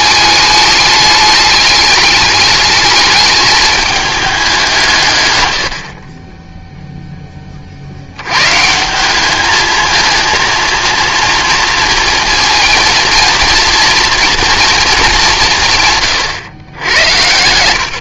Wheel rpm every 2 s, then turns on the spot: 210, 210, 160, 0, 170, 230, 230, 220, 90.
16-18